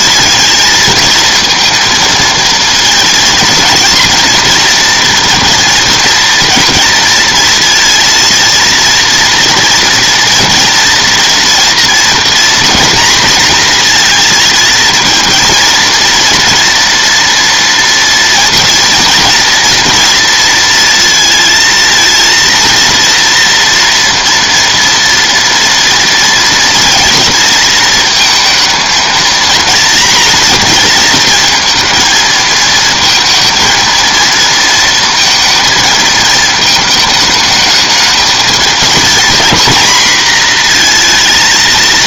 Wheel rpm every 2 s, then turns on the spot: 230, 230, 230, 230, 230, 230, 230, 230, 240, 230, 230, 230, 230, 240, 230, 230, 220, 230, 220, 230, 230.
none